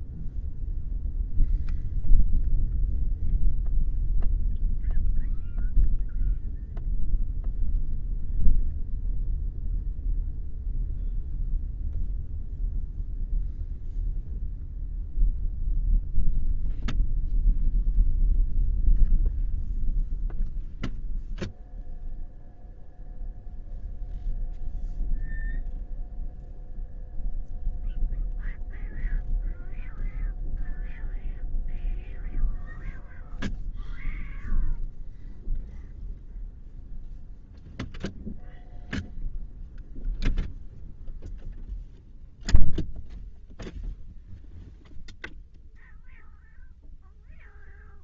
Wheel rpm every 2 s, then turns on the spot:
0, 0, 0, 0, 0, 0, 0, 0, 0, 0, 0, 0, 0, 0, 0, 0, 0, 0, 0, 0, 0, 0, 0, 0.
none